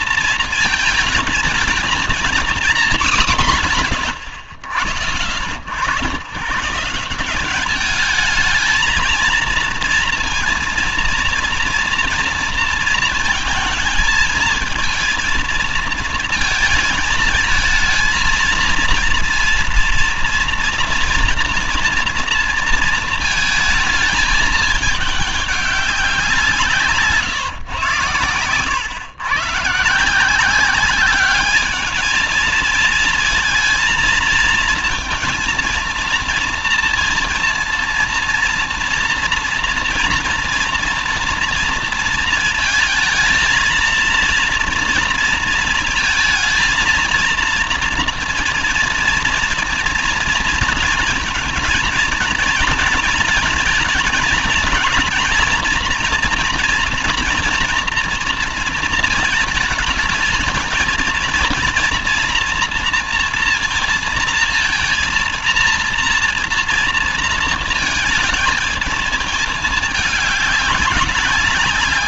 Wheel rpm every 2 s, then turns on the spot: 220, 210, 40, 160, 220, 230, 230, 230, 220, 230, 230, 230, 220, 160, 120, 190, 230, 230, 230, 230, 230, 220, 230, 230, 230, 240, 230, 230, 230, 220, 230, 230, 230, 230, 220, 190.
none